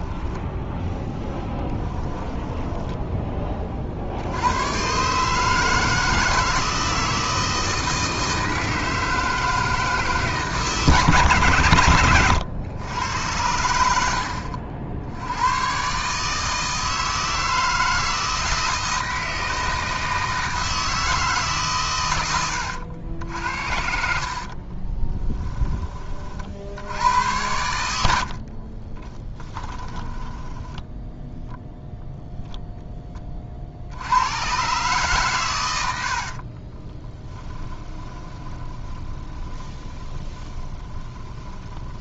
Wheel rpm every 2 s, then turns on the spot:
10, 10, 120, 160, 160, 150, 100, 70, 160, 160, 160, 90, 30, 80, 30, 10, 10, 130, 20, 20, 20.
0-2 24-26 28-32 36-42